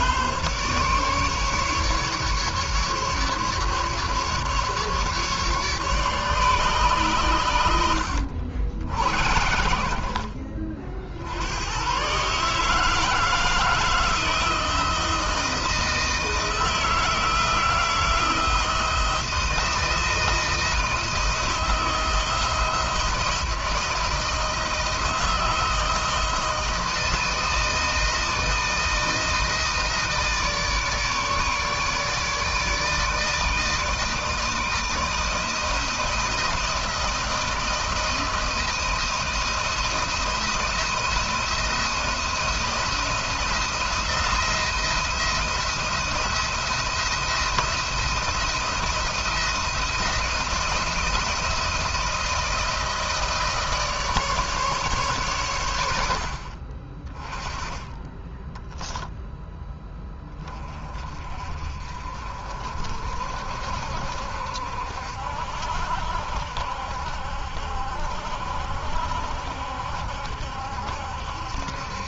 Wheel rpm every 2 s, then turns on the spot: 140, 150, 150, 130, 80, 60, 160, 170, 160, 160, 170, 170, 160, 160, 160, 150, 160, 160, 160, 160, 170, 170, 170, 170, 170, 170, 170, 140, 30, 0, 30, 50, 60, 70, 70, 70.
none